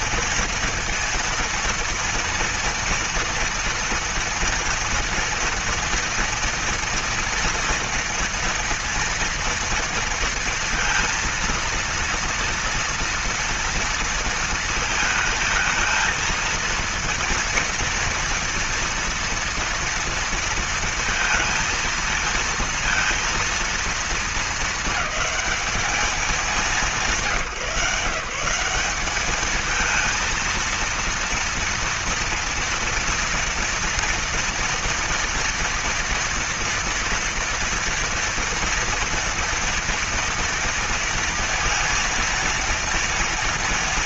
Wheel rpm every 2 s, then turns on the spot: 230, 230, 230, 230, 230, 230, 230, 230, 230, 230, 230, 230, 220, 210, 180, 230, 230, 230, 230, 230, 230, 230.
none